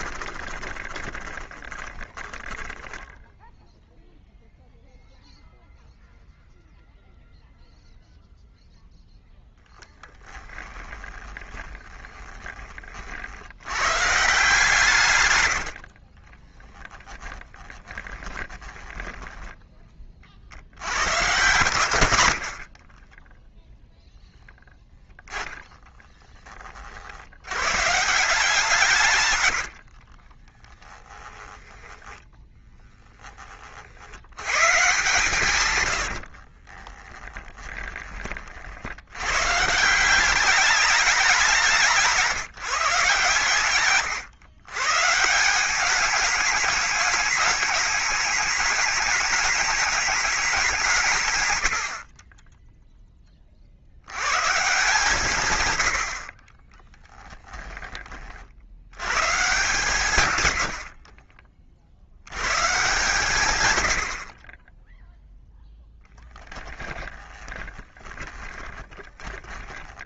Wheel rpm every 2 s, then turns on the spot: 20, 10, 0, 0, 0, 20, 40, 140, 40, 20, 90, 40, 0, 40, 160, 20, 10, 130, 20, 70, 200, 150, 120, 210, 210, 180, 0, 150, 20, 90, 70, 130, 20, 20, 20.
0-4 10-12 16-20 22-24 30-34 36-38 60-62 66-70